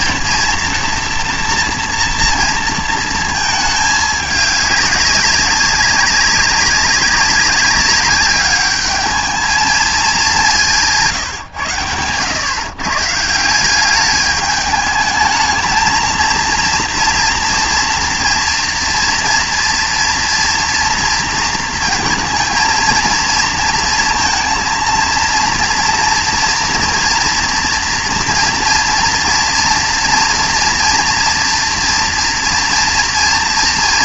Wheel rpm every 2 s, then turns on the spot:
230, 230, 200, 200, 200, 200, 130, 210, 230, 240, 230, 230, 230, 230, 230, 230, 240.
none